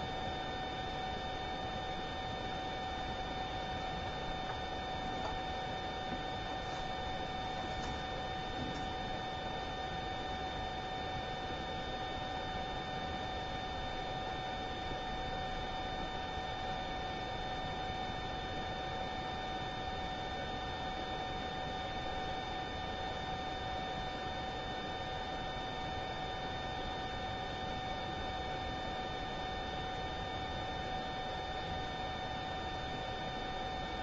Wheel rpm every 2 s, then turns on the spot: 0, 0, 0, 0, 0, 0, 0, 0, 0, 0, 0, 0, 0, 0, 0, 0, 0.
none